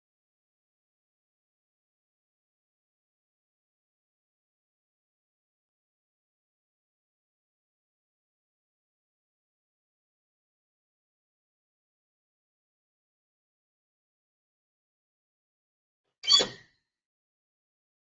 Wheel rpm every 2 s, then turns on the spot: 0, 0, 0, 0, 0, 0, 0, 0, 0.
none